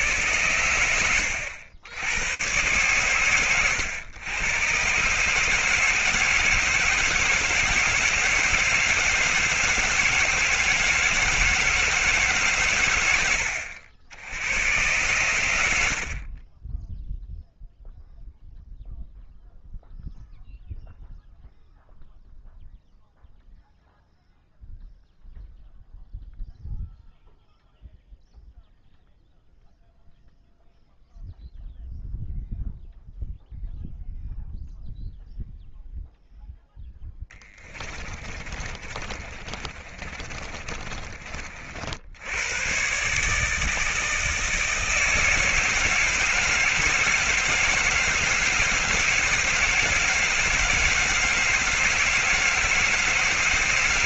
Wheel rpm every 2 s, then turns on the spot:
80, 100, 160, 160, 160, 160, 70, 70, 0, 0, 0, 0, 0, 0, 0, 0, 0, 0, 10, 30, 50, 150, 160, 160, 160, 160, 160.
14-16 36-40